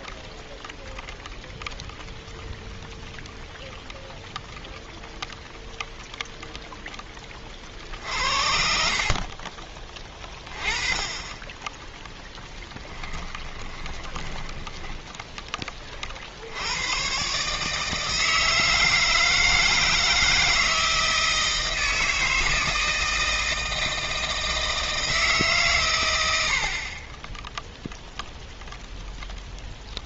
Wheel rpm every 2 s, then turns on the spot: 0, 0, 0, 0, 60, 20, 10, 10, 70, 160, 160, 160, 160, 90, 0.
12-16